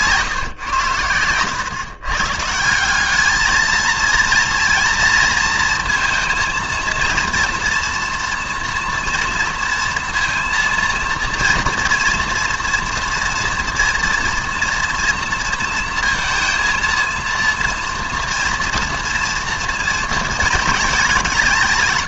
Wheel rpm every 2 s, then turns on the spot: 120, 180, 230, 230, 230, 230, 230, 230, 230, 230, 210.
none